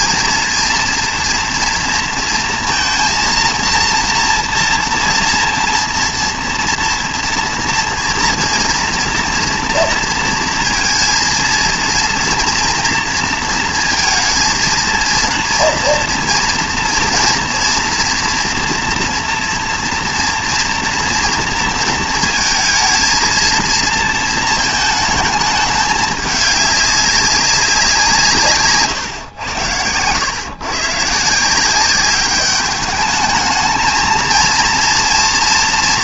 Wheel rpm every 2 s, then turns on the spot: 220, 230, 240, 230, 230, 230, 230, 230, 230, 230, 240, 230, 230, 200, 140, 120, 200, 230.
none